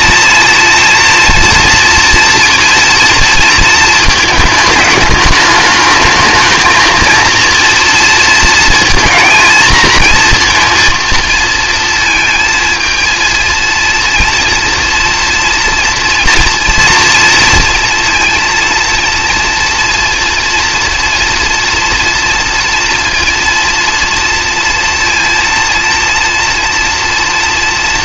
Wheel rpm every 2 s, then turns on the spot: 240, 230, 210, 220, 230, 230, 220, 230, 230, 230, 230, 230, 230, 230.
none